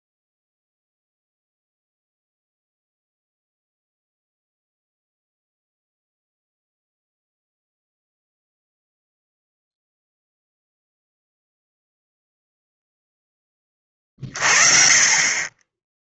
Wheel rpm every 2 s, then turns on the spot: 0, 0, 0, 0, 0, 0, 0, 30.
none